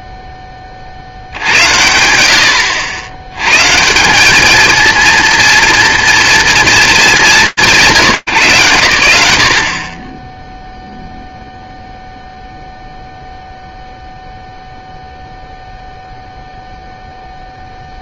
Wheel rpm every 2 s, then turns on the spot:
40, 60, 220, 230, 160, 30, 0, 0, 0.
none